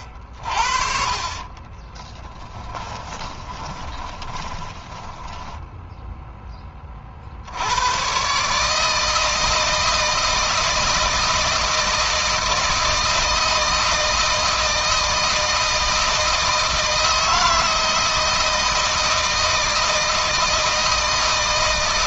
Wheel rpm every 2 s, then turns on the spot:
50, 20, 20, 20, 150, 160, 160, 160, 160, 160, 160.
2-6